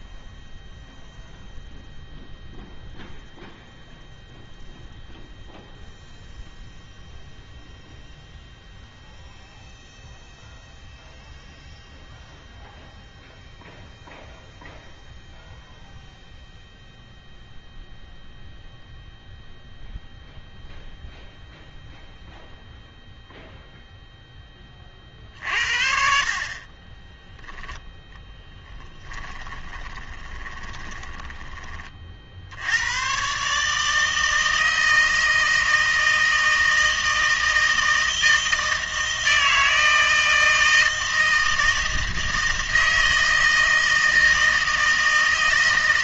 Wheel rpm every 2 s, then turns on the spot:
0, 0, 0, 0, 0, 0, 0, 0, 0, 0, 0, 0, 20, 40, 20, 20, 90, 160, 160, 160, 160, 160, 160.
28-32